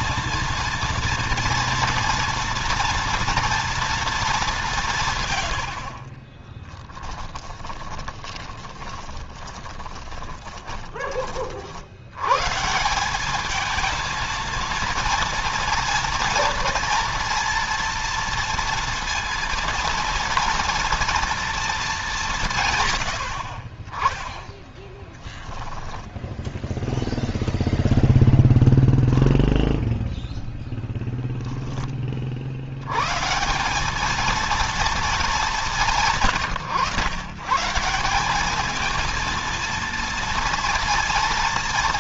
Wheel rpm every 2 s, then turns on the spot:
230, 230, 190, 20, 20, 20, 150, 230, 230, 230, 230, 160, 10, 0, 0, 0, 80, 230, 130, 210, 230.
6-12 24-26